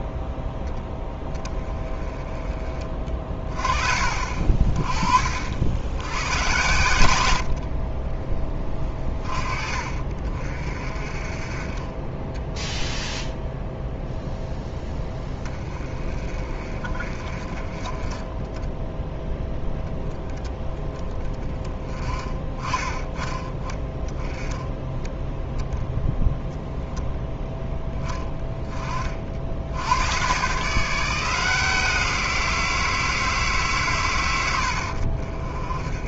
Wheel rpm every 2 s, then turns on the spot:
10, 30, 40, 100, 30, 40, 0, 10, 40, 0, 20, 20, 10, 0, 30, 160, 170, 70.
none